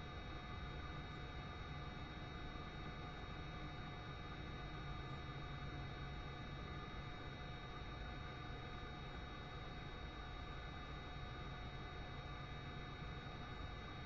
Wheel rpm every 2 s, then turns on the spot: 0, 0, 0, 0, 0, 0, 0.
none